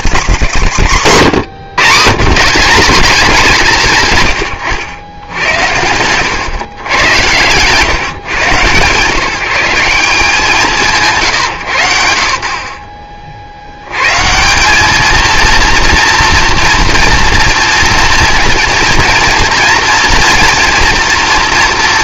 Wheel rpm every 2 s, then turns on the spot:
170, 190, 110, 100, 130, 160, 40, 210, 230, 230, 230.
4-6